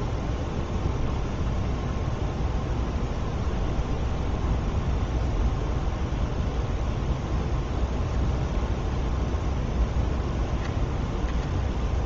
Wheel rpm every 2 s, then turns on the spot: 0, 0, 0, 0, 0, 0.
none